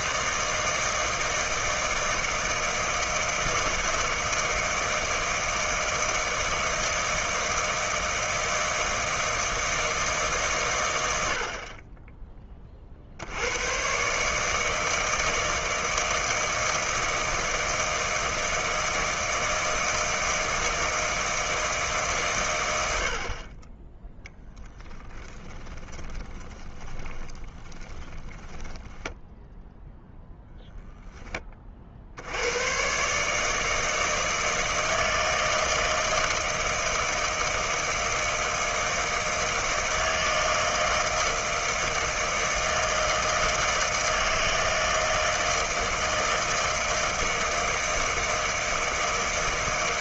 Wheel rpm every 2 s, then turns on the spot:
160, 160, 160, 160, 160, 110, 40, 160, 160, 160, 160, 80, 10, 20, 10, 0, 120, 160, 160, 160, 160, 160, 160, 160, 160.
24-30